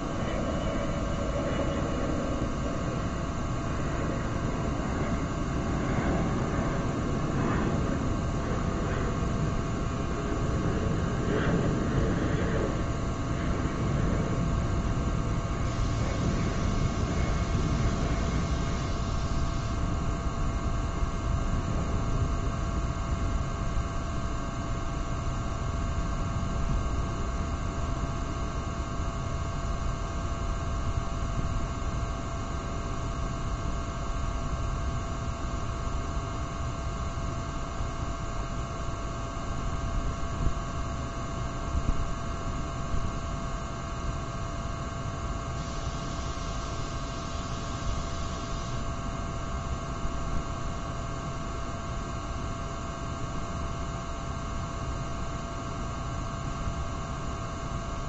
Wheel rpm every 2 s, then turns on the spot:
0, 0, 0, 0, 0, 0, 0, 0, 0, 0, 0, 0, 0, 0, 0, 0, 0, 0, 0, 0, 0, 0, 0, 0, 0, 0, 0, 0, 0.
none